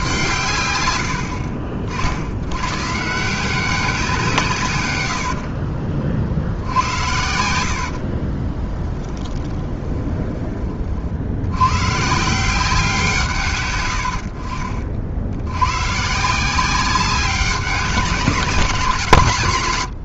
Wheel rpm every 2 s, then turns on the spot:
110, 130, 120, 80, 10, 30, 180, 60, 180, 190.
8-10